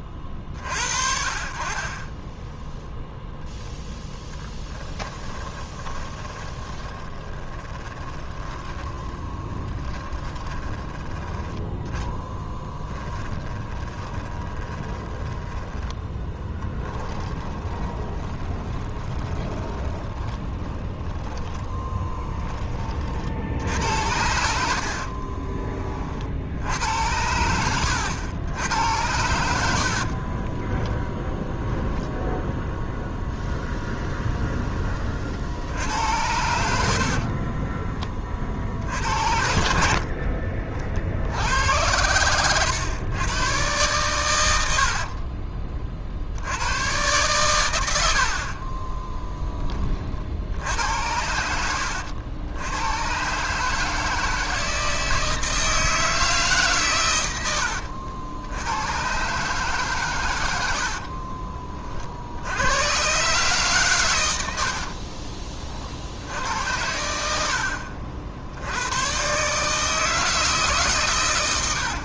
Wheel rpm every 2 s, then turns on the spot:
40, 10, 10, 20, 20, 10, 20, 20, 10, 20, 10, 30, 70, 70, 90, 20, 0, 10, 80, 50, 40, 110, 80, 90, 30, 60, 100, 160, 140, 90, 80, 90, 70, 90, 80, 150.
4-22 30-32 48-50 64-66